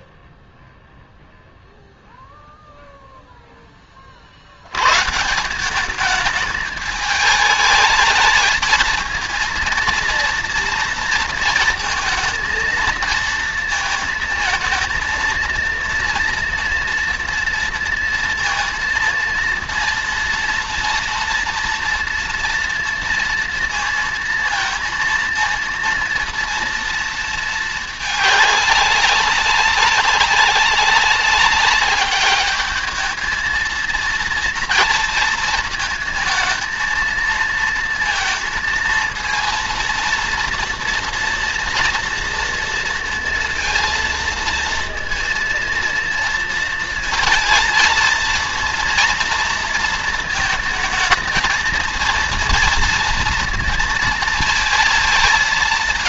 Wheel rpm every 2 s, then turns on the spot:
0, 0, 70, 210, 220, 230, 230, 230, 230, 230, 230, 230, 230, 230, 210, 190, 210, 230, 220, 220, 230, 230, 230, 230, 230, 220, 230, 230.
none